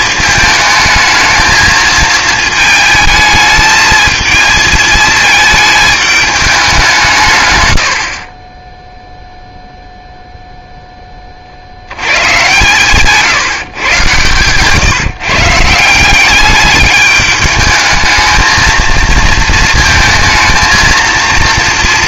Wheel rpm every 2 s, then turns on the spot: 220, 220, 220, 190, 10, 0, 130, 140, 200, 220, 230.
none